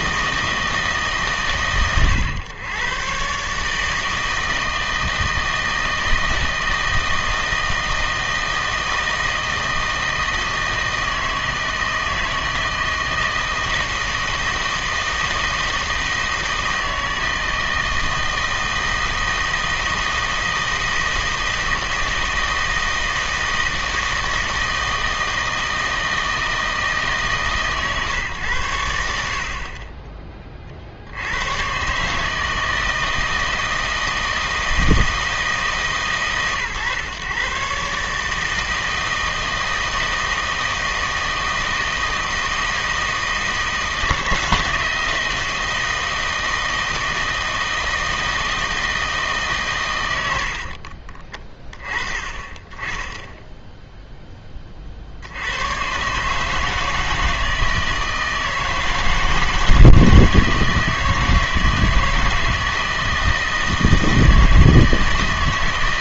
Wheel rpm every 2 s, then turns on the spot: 160, 120, 160, 160, 160, 160, 160, 160, 160, 160, 160, 160, 160, 160, 90, 40, 160, 160, 130, 160, 160, 160, 170, 160, 160, 50, 20, 30, 160, 160, 160, 160, 160.
50-52